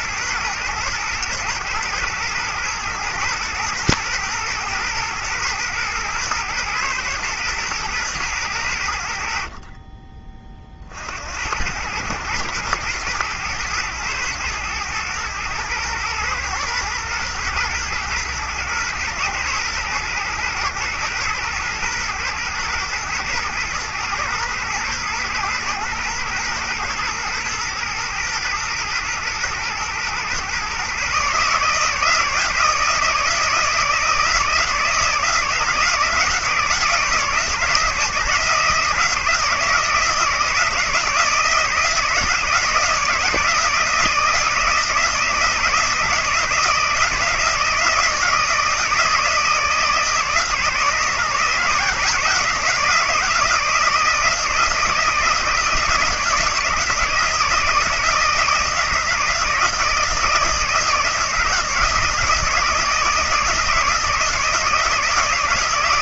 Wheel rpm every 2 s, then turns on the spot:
120, 110, 110, 110, 90, 40, 110, 110, 110, 110, 120, 110, 120, 120, 110, 130, 160, 160, 160, 160, 160, 160, 160, 170, 160, 150, 160, 160, 170, 160, 160, 160, 170.
none